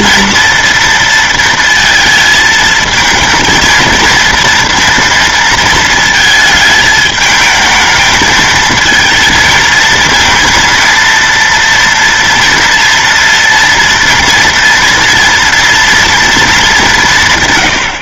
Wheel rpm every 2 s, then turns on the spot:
230, 230, 230, 220, 220, 230, 230, 230, 200.
none